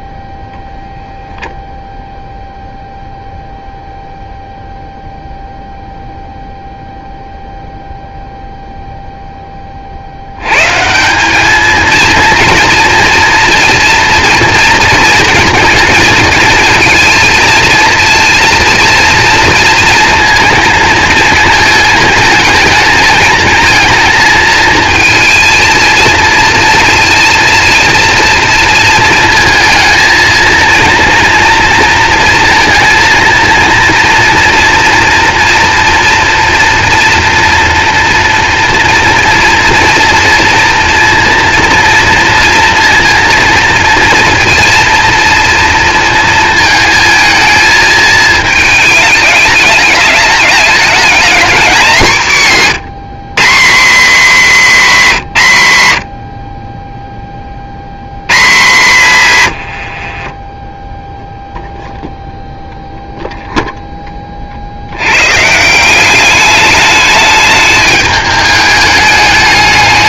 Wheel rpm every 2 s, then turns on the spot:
0, 0, 0, 0, 0, 130, 230, 230, 220, 230, 230, 220, 230, 230, 230, 230, 230, 230, 230, 230, 230, 230, 230, 220, 220, 200, 170, 240, 30, 150, 10, 0, 60, 210, 210.
60-62